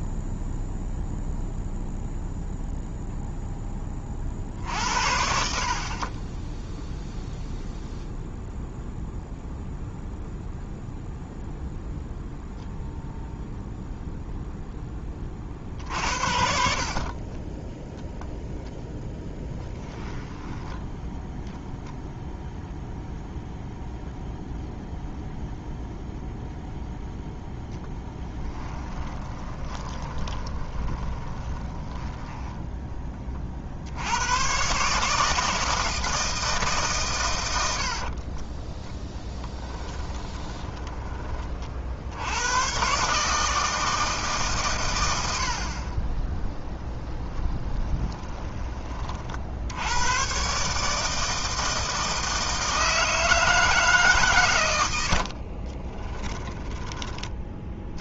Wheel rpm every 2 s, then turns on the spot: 0, 0, 60, 0, 0, 0, 0, 10, 50, 0, 10, 0, 0, 0, 20, 20, 10, 140, 150, 10, 20, 120, 120, 0, 20, 140, 160, 100, 20.
20-22 28-32 40-42